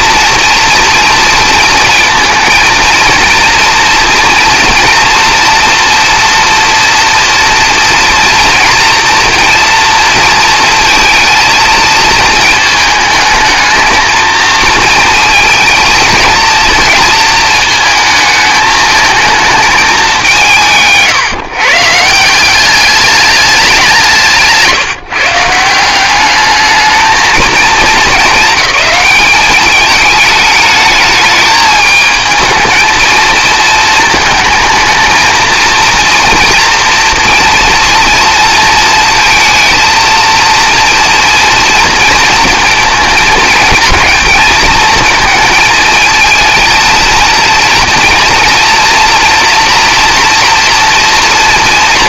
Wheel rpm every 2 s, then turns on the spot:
240, 230, 240, 230, 230, 230, 220, 220, 230, 220, 160, 200, 160, 210, 200, 210, 220, 220, 240, 230, 230, 220, 220, 230, 230, 230.
none